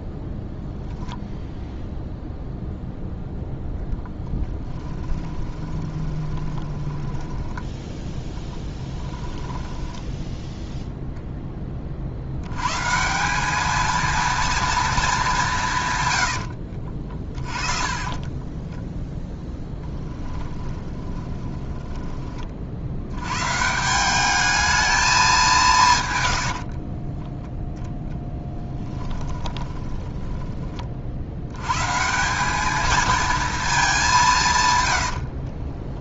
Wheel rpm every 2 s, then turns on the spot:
0, 0, 10, 20, 10, 0, 120, 230, 50, 10, 20, 60, 220, 60, 10, 30, 210, 140.
4-10 16-22 26-30